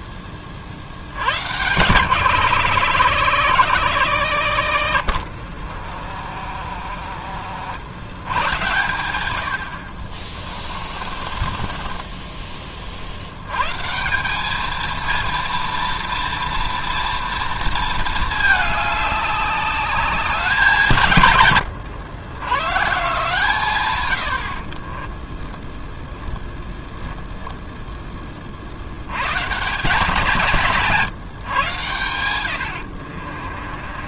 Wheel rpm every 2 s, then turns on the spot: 50, 90, 50, 20, 110, 30, 30, 220, 230, 210, 180, 120, 50, 0, 60, 160, 80.
10-12 32-34